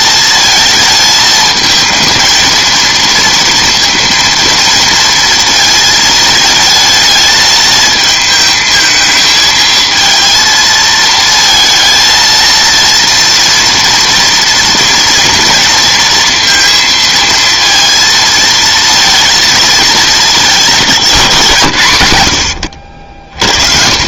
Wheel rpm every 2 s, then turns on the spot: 220, 230, 230, 220, 220, 230, 230, 240, 230, 230, 200, 100.
none